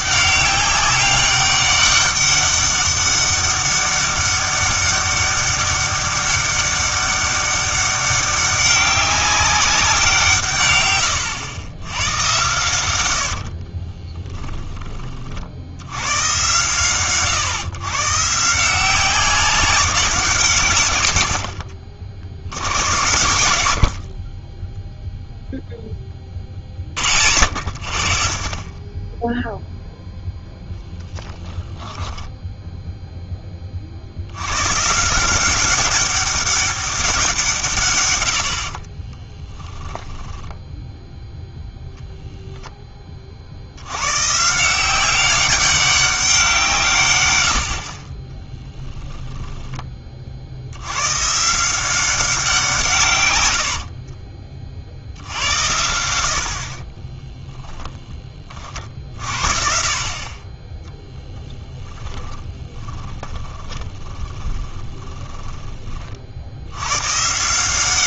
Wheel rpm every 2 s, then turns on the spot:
200, 200, 200, 200, 200, 130, 100, 10, 130, 170, 130, 100, 10, 40, 20, 0, 0, 110, 190, 60, 10, 10, 170, 160, 10, 80, 160, 50, 50, 40, 20, 20, 20, 100.
40-42 62-66